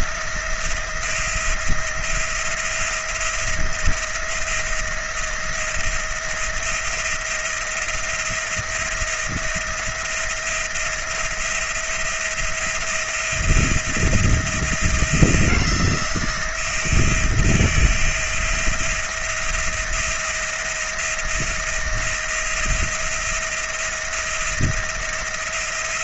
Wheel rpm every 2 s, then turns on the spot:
170, 170, 170, 170, 170, 170, 170, 170, 170, 170, 170, 170, 170.
none